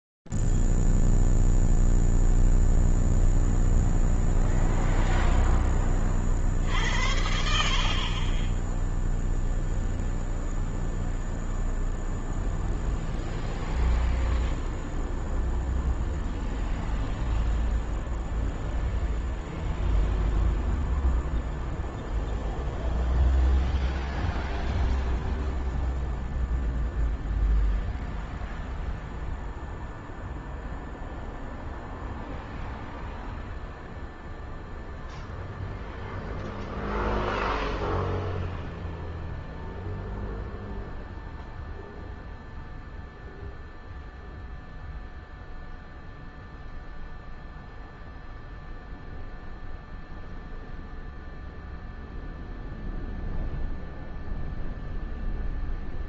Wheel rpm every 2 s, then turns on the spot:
0, 0, 0, 10, 60, 0, 0, 0, 0, 0, 0, 0, 0, 0, 0, 0, 0, 0, 0, 0, 0, 0, 0, 0, 0, 0, 0, 0.
none